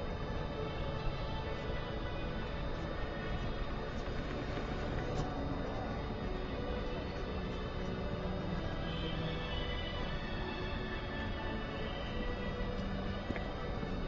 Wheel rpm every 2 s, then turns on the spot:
0, 0, 0, 0, 0, 0, 0.
none